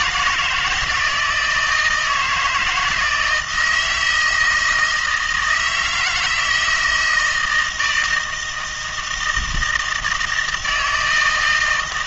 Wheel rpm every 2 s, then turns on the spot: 170, 160, 160, 160, 160, 160.
none